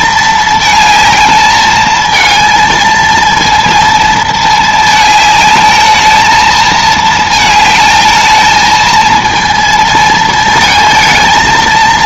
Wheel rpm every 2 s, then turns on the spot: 220, 230, 220, 220, 220, 220.
none